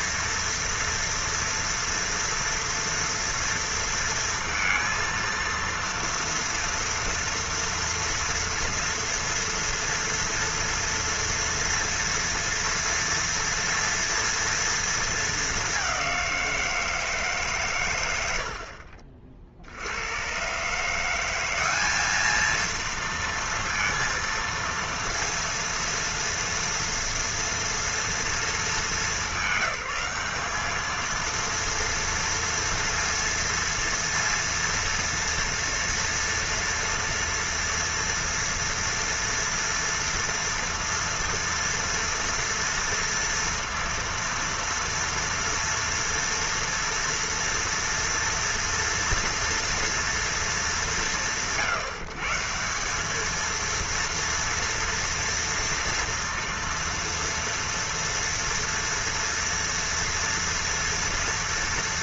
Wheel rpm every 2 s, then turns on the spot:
230, 230, 230, 230, 230, 230, 230, 230, 180, 80, 120, 220, 230, 230, 220, 200, 230, 230, 230, 230, 230, 230, 230, 230, 230, 230, 160, 230, 240, 230, 230.
none